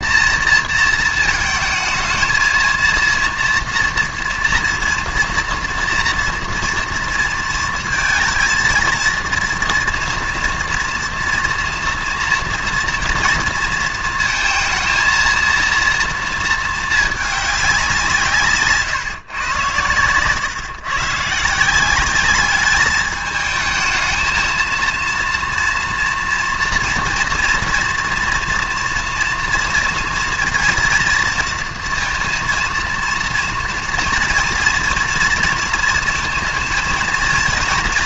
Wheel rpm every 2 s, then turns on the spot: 230, 230, 230, 230, 230, 230, 230, 230, 220, 150, 120, 210, 220, 230, 230, 230, 230, 230, 230.
none